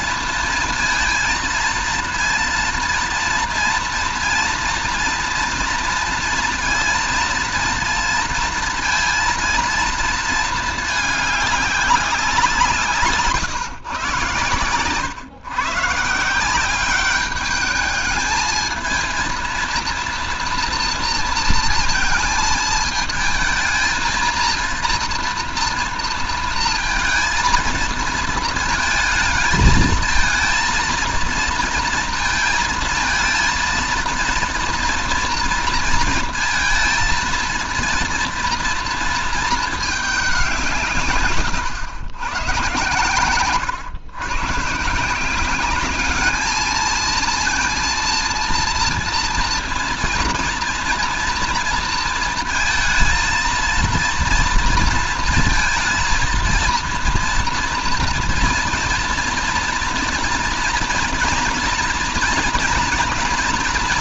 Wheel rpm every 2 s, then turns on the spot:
230, 230, 230, 230, 230, 220, 170, 120, 190, 220, 230, 220, 230, 230, 220, 230, 220, 230, 230, 230, 180, 120, 130, 220, 230, 230, 230, 230, 230, 230, 230, 230.
none